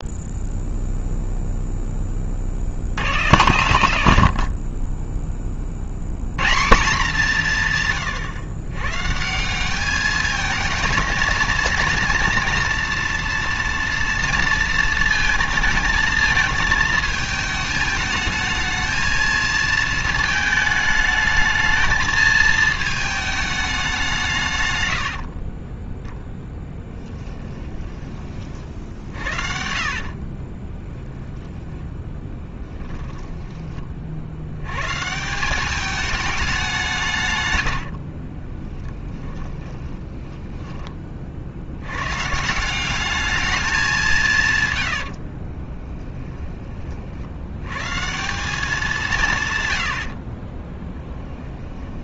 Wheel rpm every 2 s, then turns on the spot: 0, 70, 30, 190, 130, 220, 240, 220, 220, 220, 220, 220, 100, 10, 60, 10, 10, 130, 170, 20, 20, 190, 110, 30, 190, 20.
26-28 30-34 38-40 44-46 50-52